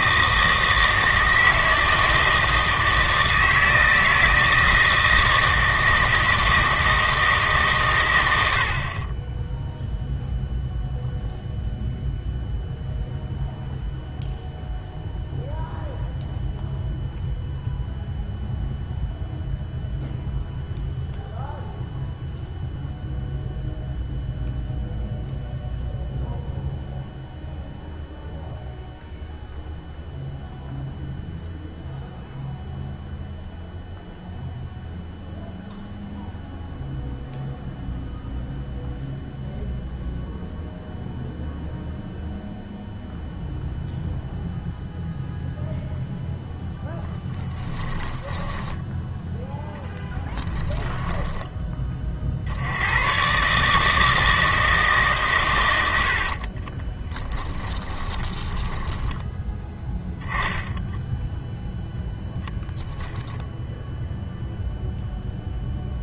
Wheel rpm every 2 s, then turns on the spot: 160, 160, 160, 160, 60, 0, 0, 0, 0, 0, 0, 0, 0, 0, 0, 0, 0, 0, 0, 0, 0, 0, 0, 0, 10, 10, 90, 160, 30, 20, 0, 10, 0.
50-52 56-60